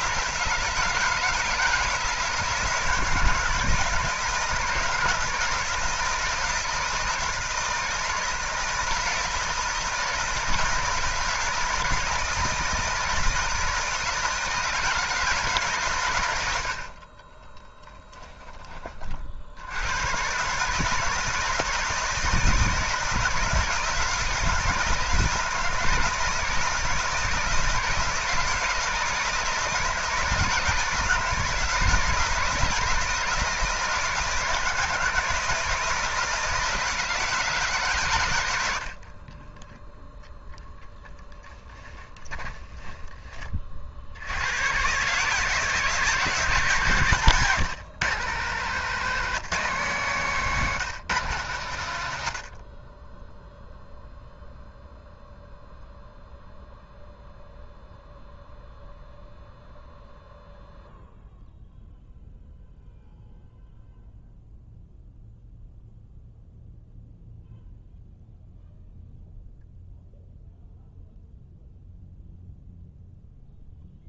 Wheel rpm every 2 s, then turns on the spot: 170, 160, 160, 160, 160, 160, 160, 160, 90, 20, 140, 160, 160, 160, 160, 160, 160, 160, 160, 100, 10, 10, 110, 150, 160, 170, 40, 0, 0, 0, 0, 0, 0, 0, 0, 0, 0.
16-18 38-40 42-44